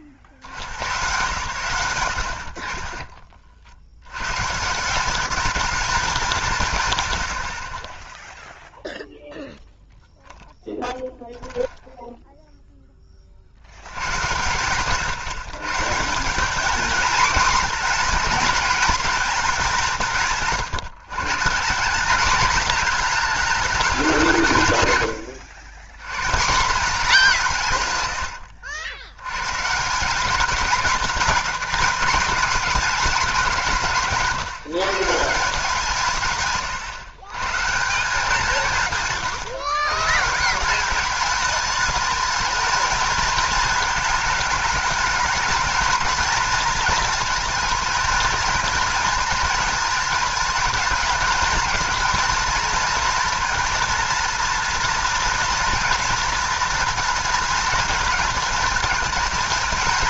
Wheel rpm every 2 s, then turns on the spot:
60, 50, 170, 130, 0, 0, 10, 130, 220, 220, 160, 220, 120, 190, 80, 210, 220, 170, 120, 160, 190, 220, 220, 230, 230, 220, 230, 230, 230, 220.
36-40